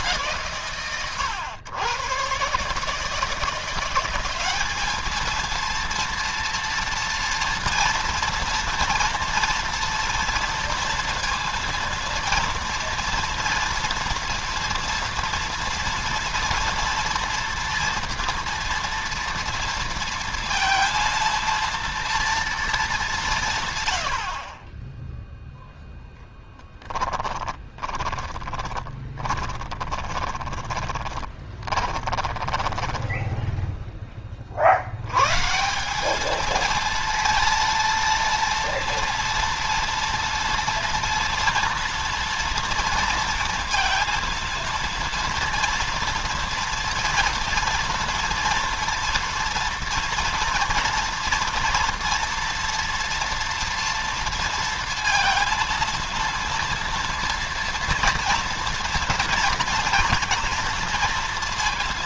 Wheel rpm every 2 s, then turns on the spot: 140, 130, 200, 230, 230, 230, 230, 230, 230, 240, 230, 220, 40, 10, 20, 20, 20, 40, 220, 230, 230, 230, 230, 230, 230, 240, 230, 230, 230, 230, 230.
26-34